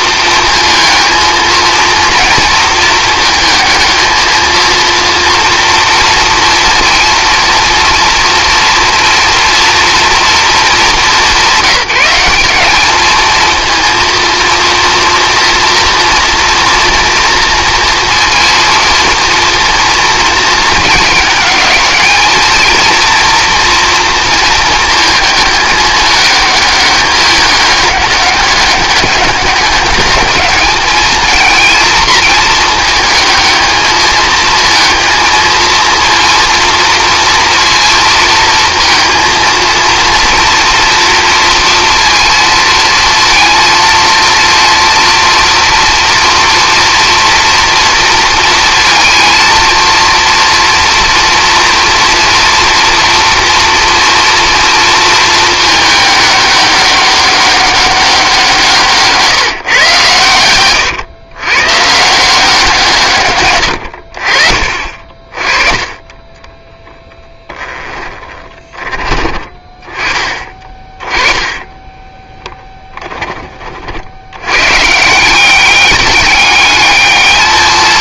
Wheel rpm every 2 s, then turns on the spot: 220, 220, 230, 230, 230, 210, 210, 230, 230, 230, 220, 230, 220, 210, 200, 220, 220, 230, 230, 230, 230, 230, 230, 230, 230, 240, 230, 230, 200, 160, 110, 160, 50, 10, 30, 30, 10, 130, 210.
64-68 70-72